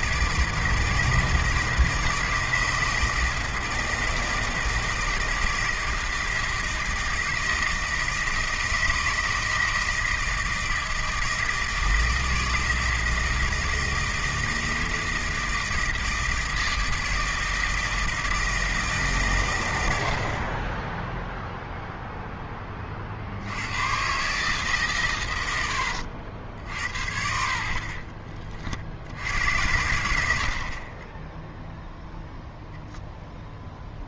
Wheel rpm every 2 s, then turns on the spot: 160, 160, 160, 160, 160, 160, 160, 160, 160, 160, 30, 20, 140, 60, 50, 50, 0.
30-32